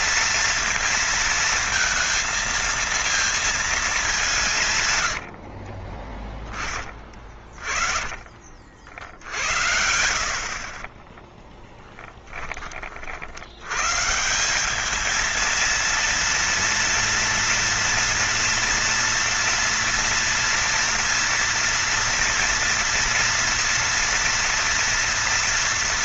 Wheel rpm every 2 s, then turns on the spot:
230, 230, 130, 30, 50, 40, 40, 200, 230, 230, 230, 230, 230.
4-8